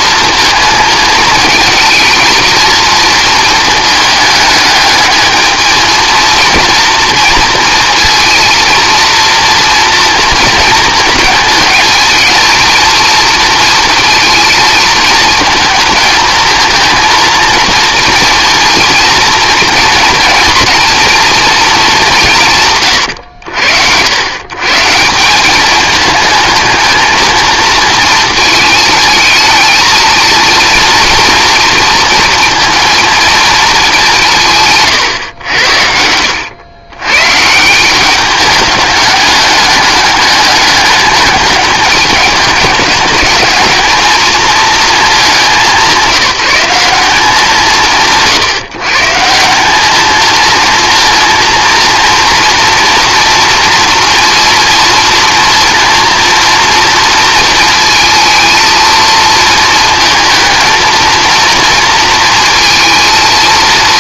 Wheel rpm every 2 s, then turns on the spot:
220, 220, 210, 230, 230, 230, 220, 220, 230, 230, 240, 130, 150, 220, 220, 230, 230, 130, 110, 200, 210, 200, 220, 190, 150, 230, 240, 230, 230, 230, 230, 230.
34-36